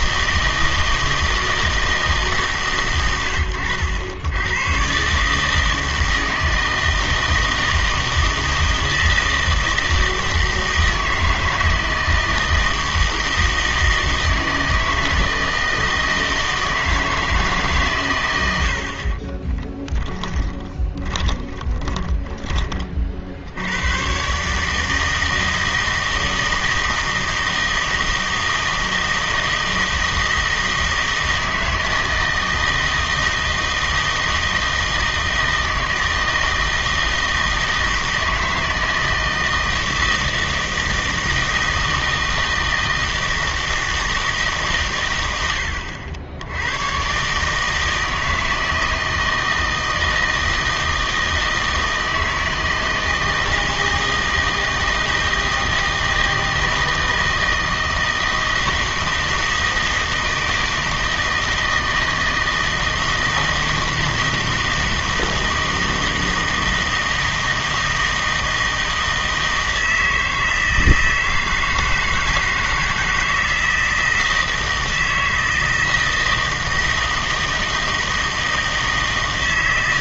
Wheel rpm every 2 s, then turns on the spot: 160, 120, 130, 160, 160, 160, 160, 160, 160, 60, 10, 30, 150, 160, 160, 160, 160, 160, 160, 160, 160, 160, 130, 110, 160, 160, 160, 160, 160, 160, 160, 160, 160, 160, 160, 160, 160, 160, 160, 160.
20-22